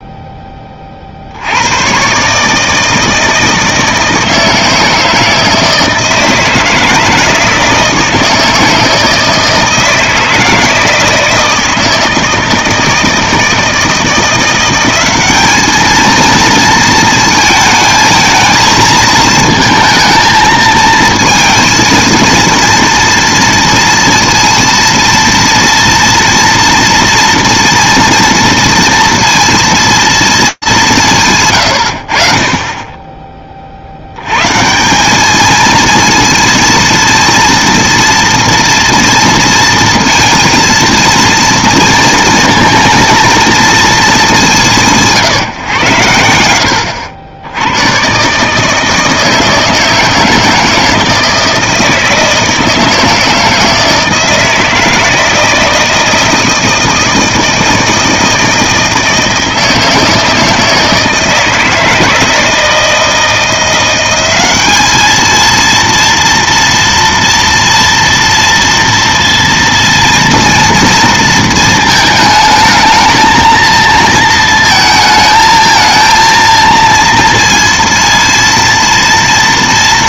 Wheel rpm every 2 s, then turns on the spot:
20, 150, 160, 160, 160, 160, 160, 180, 230, 220, 220, 230, 230, 230, 230, 190, 20, 160, 230, 230, 230, 230, 180, 90, 150, 160, 160, 160, 160, 160, 160, 160, 200, 230, 230, 230, 220, 230, 230, 230.
none